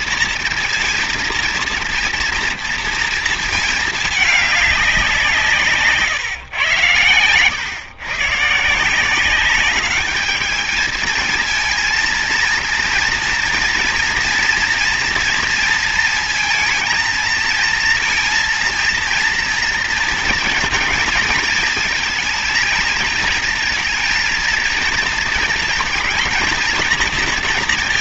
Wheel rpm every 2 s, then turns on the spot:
230, 230, 200, 120, 150, 220, 230, 230, 230, 230, 230, 220, 230, 230.
none